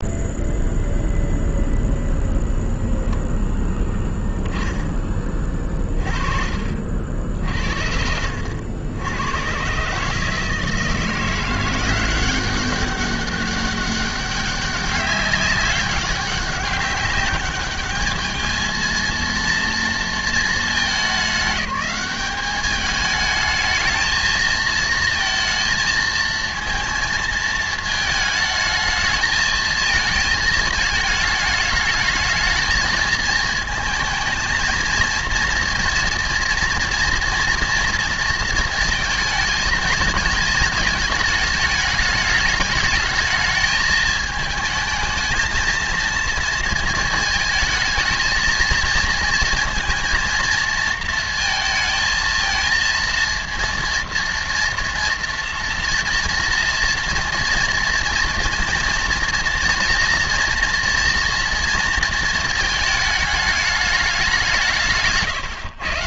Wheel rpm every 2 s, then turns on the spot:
0, 10, 30, 50, 110, 170, 200, 200, 200, 230, 210, 210, 230, 220, 220, 220, 220, 230, 240, 230, 220, 220, 220, 220, 230, 230, 230, 230, 240, 230, 230, 210, 150.
none